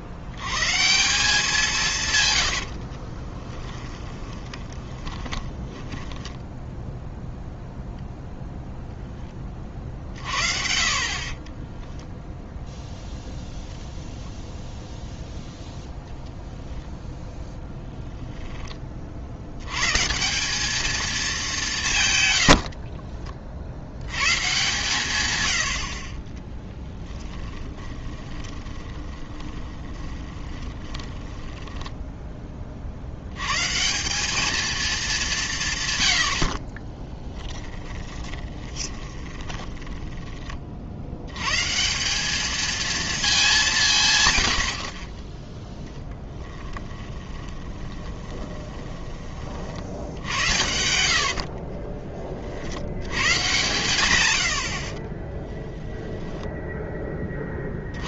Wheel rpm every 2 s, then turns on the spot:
110, 80, 20, 10, 0, 40, 0, 0, 0, 10, 200, 80, 130, 10, 20, 20, 40, 220, 60, 20, 30, 220, 70, 10, 20, 70, 60, 80, 0.
2-8 22-24 26-32 38-40 46-52